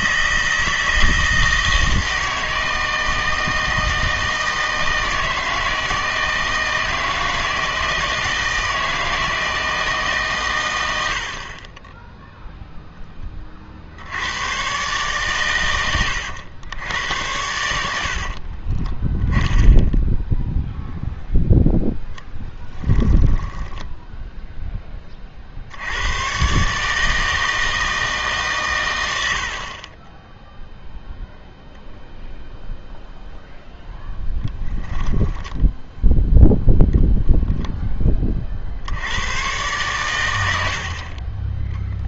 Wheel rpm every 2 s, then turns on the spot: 160, 160, 160, 160, 160, 110, 0, 120, 90, 30, 0, 10, 10, 140, 140, 0, 0, 10, 0, 50, 80.
18-20 22-24 34-36